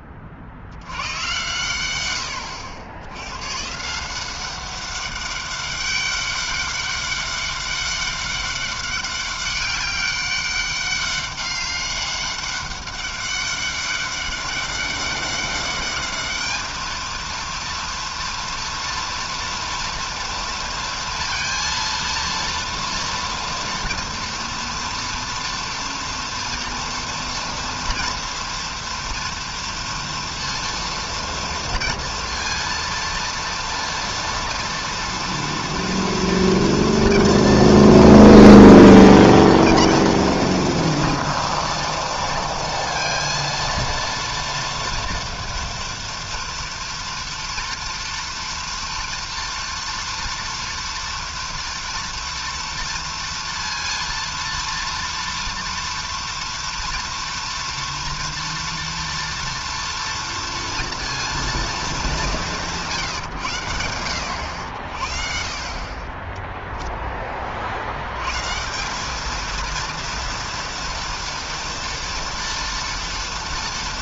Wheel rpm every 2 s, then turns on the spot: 60, 90, 190, 200, 200, 200, 200, 200, 210, 230, 230, 230, 240, 230, 230, 230, 230, 230, 230, 230, 230, 230, 230, 230, 230, 230, 230, 230, 230, 230, 230, 160, 80, 10, 150, 230, 230.
none